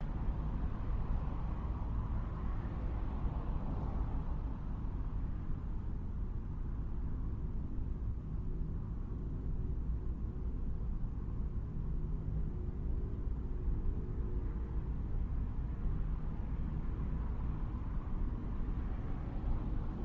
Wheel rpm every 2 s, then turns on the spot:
0, 0, 0, 0, 0, 0, 0, 0, 0, 0.
none